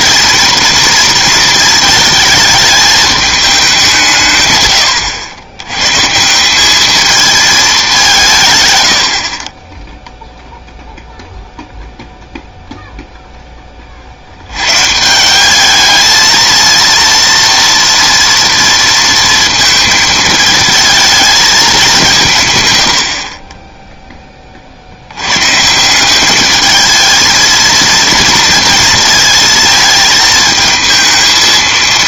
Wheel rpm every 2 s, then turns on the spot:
230, 220, 130, 190, 130, 0, 0, 100, 230, 230, 220, 130, 40, 210, 230, 220.
none